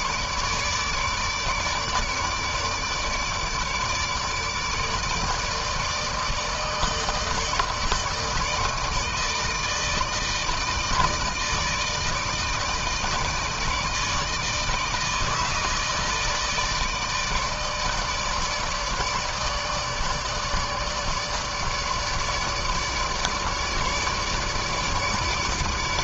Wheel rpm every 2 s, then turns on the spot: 150, 150, 150, 160, 160, 160, 160, 160, 150, 150, 150, 150, 150.
none